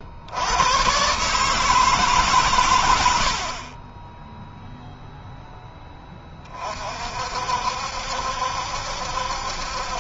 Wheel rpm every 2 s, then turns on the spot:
120, 100, 0, 50, 70.
none